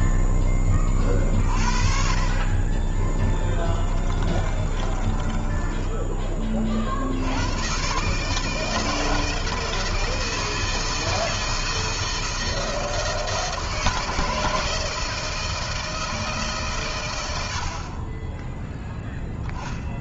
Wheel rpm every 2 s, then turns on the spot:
20, 30, 30, 40, 160, 160, 170, 160, 140, 10.
2-6